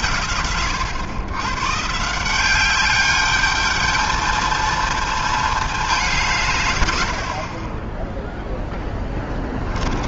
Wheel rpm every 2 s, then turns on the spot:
100, 220, 210, 40, 20.
6-10